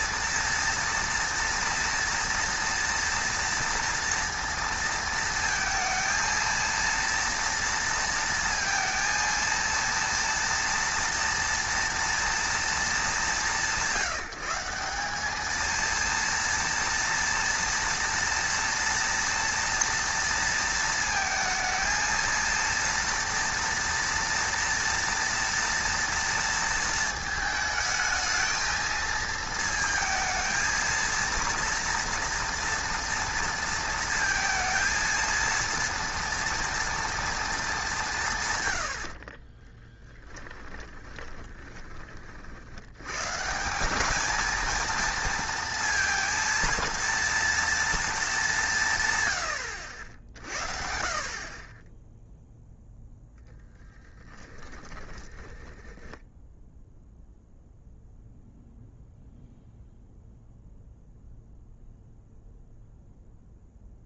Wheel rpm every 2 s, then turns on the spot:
230, 240, 230, 230, 230, 230, 230, 190, 230, 230, 230, 230, 230, 230, 220, 230, 230, 230, 230, 90, 20, 90, 230, 230, 170, 50, 0, 10, 0, 0, 0, 0.
40-42 54-56